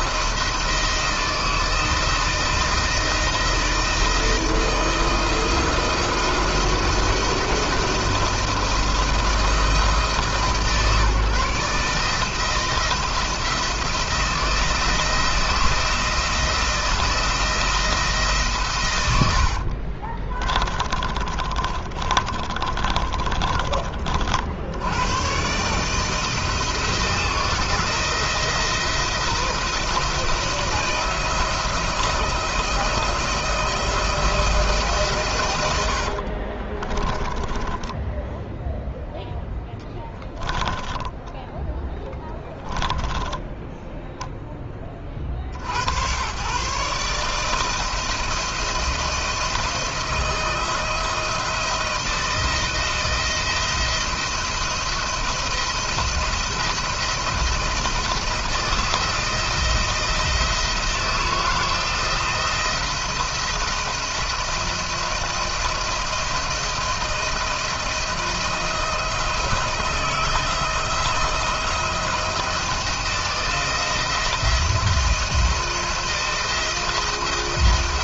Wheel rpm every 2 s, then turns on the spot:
160, 160, 160, 170, 170, 150, 160, 170, 170, 130, 30, 20, 60, 160, 170, 170, 160, 160, 40, 0, 20, 10, 10, 130, 170, 170, 170, 170, 170, 160, 160, 160, 170, 160, 160, 170, 160, 170, 170.
20-24 36-38 40-44